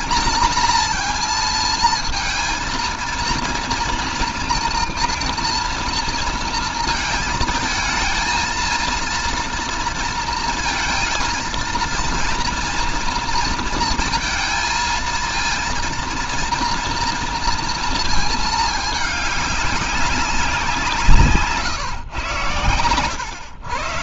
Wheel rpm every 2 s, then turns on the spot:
240, 230, 230, 230, 220, 230, 240, 230, 230, 210, 180, 120.
none